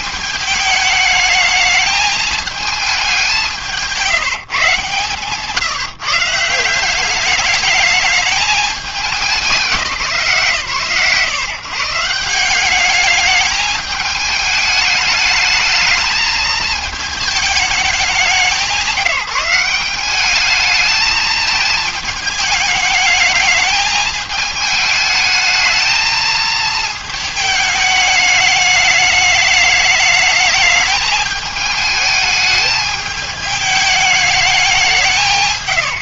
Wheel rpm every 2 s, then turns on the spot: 210, 210, 140, 180, 210, 130, 190, 210, 220, 170, 210, 210, 220, 220, 210, 210, 210, 200.
none